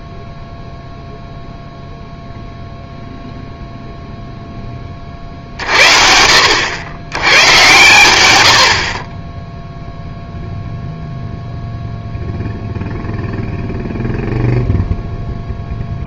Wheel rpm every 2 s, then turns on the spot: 0, 0, 30, 100, 40, 0, 0, 0.
none